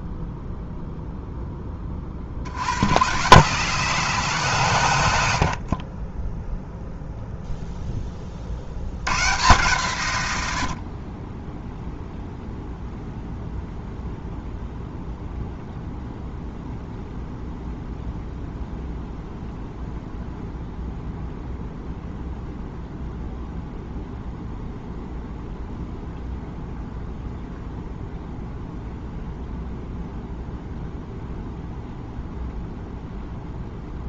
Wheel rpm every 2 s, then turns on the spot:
0, 100, 120, 0, 80, 70, 0, 0, 0, 0, 0, 0, 0, 0, 0, 0, 0.
none